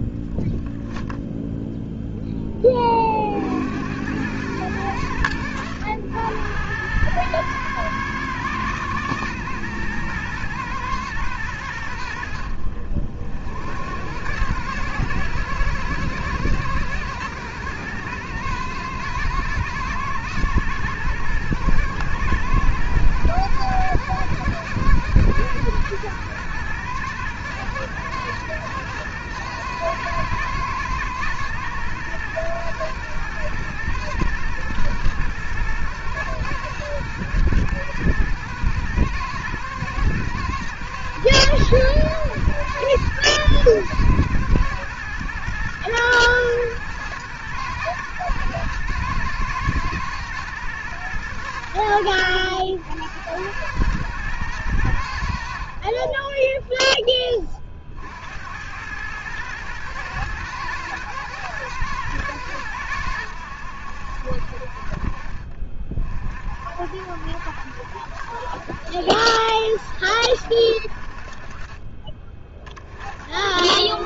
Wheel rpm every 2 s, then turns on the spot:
0, 20, 100, 100, 120, 110, 70, 110, 120, 110, 120, 120, 110, 110, 110, 110, 120, 120, 110, 110, 120, 110, 110, 120, 120, 110, 90, 110, 20, 100, 120, 100, 50, 60, 70, 60, 40.
none